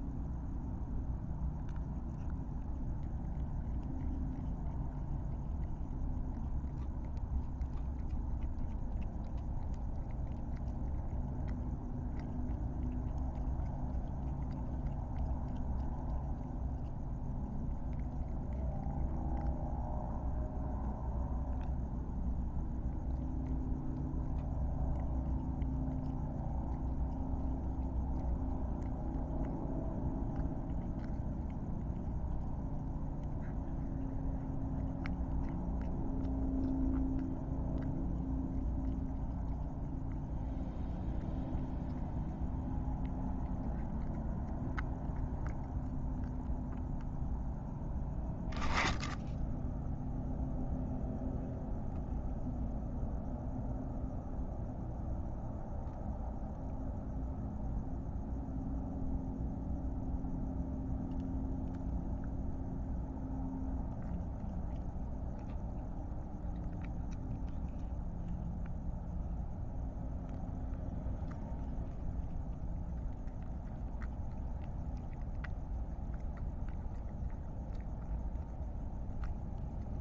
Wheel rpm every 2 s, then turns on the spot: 0, 0, 0, 0, 0, 0, 0, 0, 0, 0, 0, 0, 0, 0, 0, 0, 0, 0, 0, 0, 0, 0, 0, 0, 0, 0, 0, 0, 0, 0, 0, 0, 0, 0, 0, 0, 0, 0, 0, 0.
none